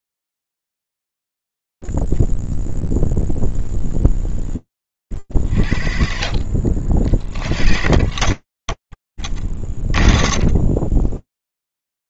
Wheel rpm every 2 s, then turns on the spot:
0, 10, 0, 50, 40, 10.
none